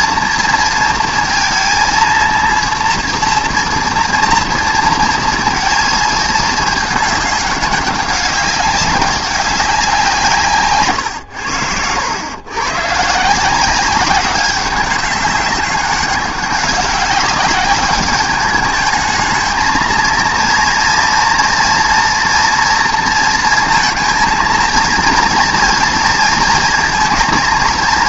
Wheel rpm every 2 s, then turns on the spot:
230, 230, 230, 220, 200, 140, 120, 190, 200, 210, 230, 230, 230, 230.
none